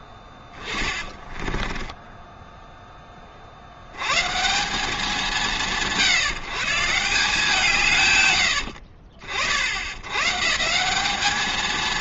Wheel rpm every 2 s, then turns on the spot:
10, 10, 120, 150, 70, 130.
0-2 8-10